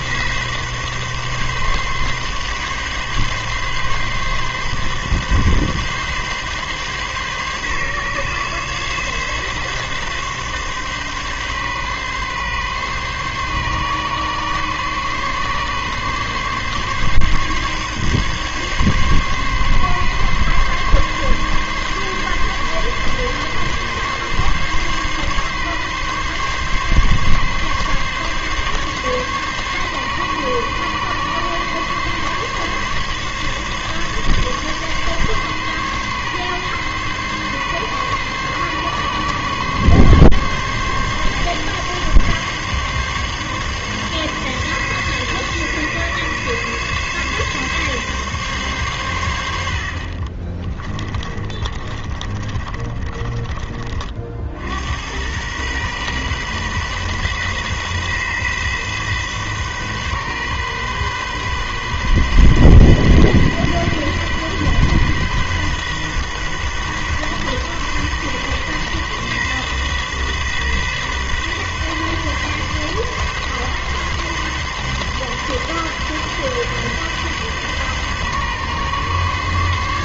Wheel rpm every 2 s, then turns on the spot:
140, 140, 140, 140, 140, 140, 140, 140, 140, 140, 140, 140, 140, 140, 140, 140, 140, 140, 140, 140, 140, 140, 140, 140, 130, 30, 30, 70, 130, 130, 130, 130, 130, 130, 130, 130, 130, 130, 130, 130.
50-54